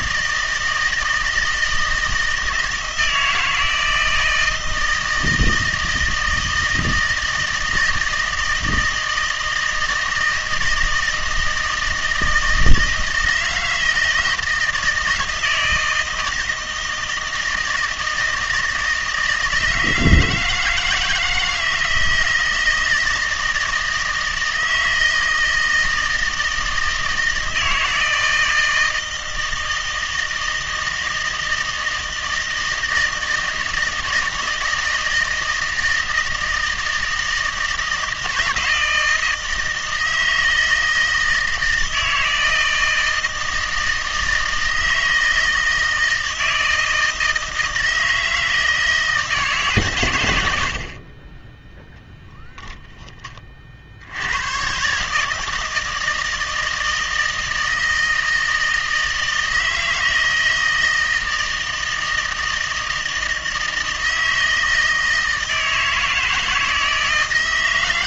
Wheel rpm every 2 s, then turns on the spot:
160, 160, 160, 160, 160, 160, 160, 160, 160, 160, 160, 160, 160, 160, 160, 160, 160, 160, 160, 160, 160, 160, 160, 160, 160, 70, 10, 120, 160, 160, 160, 160, 160, 160.
none